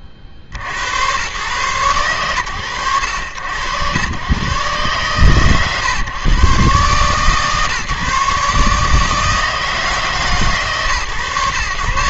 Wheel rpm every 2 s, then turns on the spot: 60, 80, 130, 140, 150, 120.
none